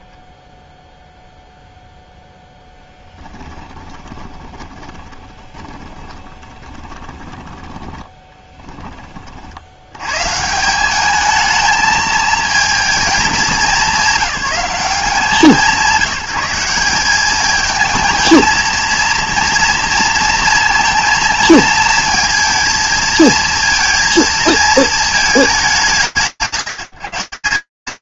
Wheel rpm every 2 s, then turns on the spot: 0, 0, 20, 10, 10, 130, 220, 190, 190, 230, 230, 230, 220, 170.
4-10